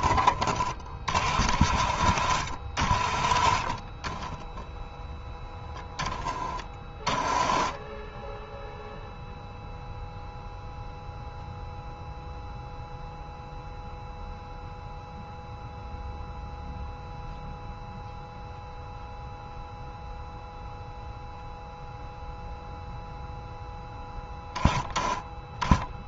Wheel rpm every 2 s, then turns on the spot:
30, 30, 10, 20, 0, 0, 0, 0, 0, 0, 0, 0, 10.
none